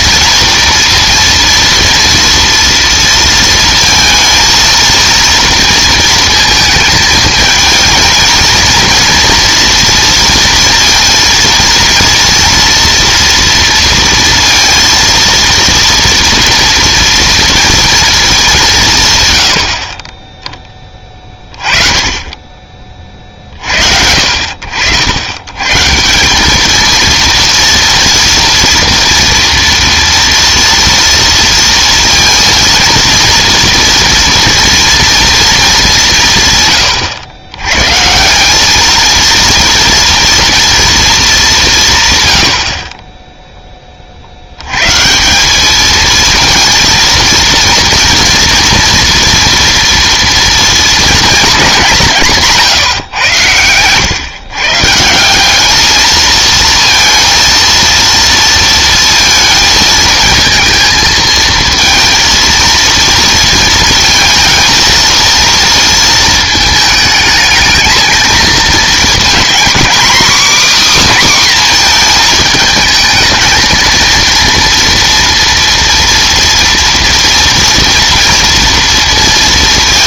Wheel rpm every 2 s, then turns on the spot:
230, 230, 230, 220, 230, 230, 230, 230, 230, 190, 10, 30, 70, 210, 240, 230, 230, 230, 120, 200, 230, 70, 100, 230, 230, 230, 150, 140, 230, 230, 230, 230, 230, 220, 220, 280, 220, 230, 230, 230.
52-54